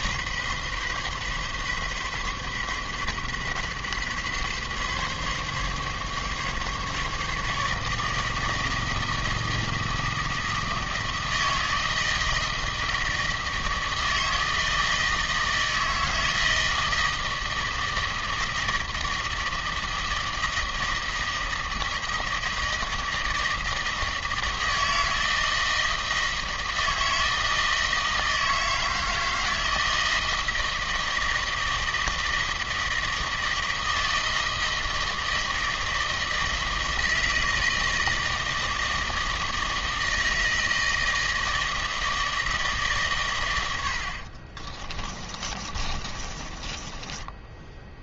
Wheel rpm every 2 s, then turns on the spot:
130, 130, 140, 150, 160, 160, 160, 160, 160, 160, 160, 160, 160, 160, 160, 160, 160, 160, 160, 160, 160, 140, 30, 10.
44-48